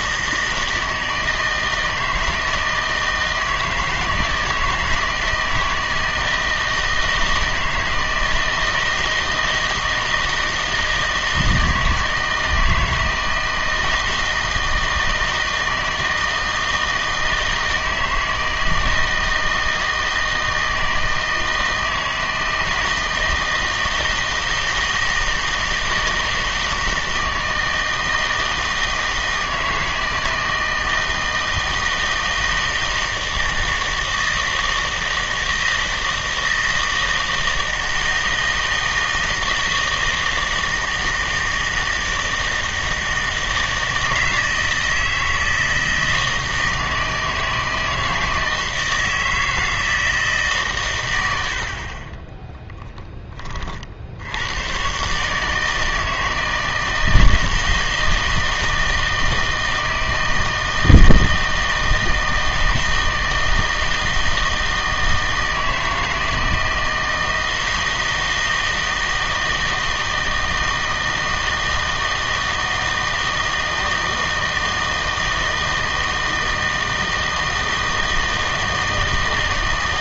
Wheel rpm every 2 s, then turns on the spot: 160, 160, 160, 160, 160, 160, 160, 160, 160, 160, 160, 160, 160, 160, 160, 160, 160, 160, 160, 160, 160, 160, 160, 160, 160, 140, 10, 110, 160, 160, 160, 160, 160, 160, 160, 160, 160, 160, 160, 160.
none